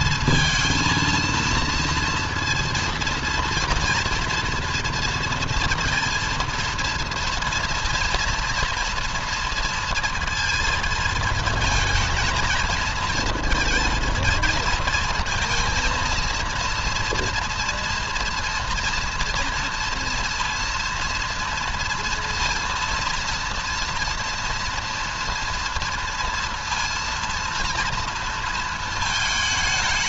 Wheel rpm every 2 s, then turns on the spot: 230, 230, 230, 230, 230, 230, 230, 230, 230, 230, 230, 230, 230, 230, 220.
none